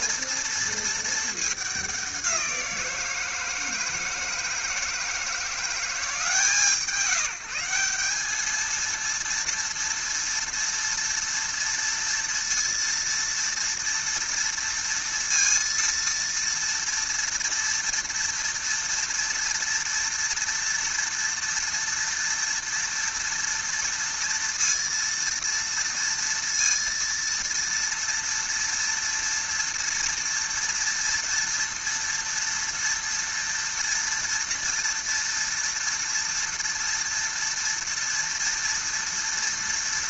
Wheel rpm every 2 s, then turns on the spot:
230, 180, 160, 160, 220, 230, 230, 230, 230, 230, 230, 230, 230, 230, 230, 230, 230, 230, 230, 230.
none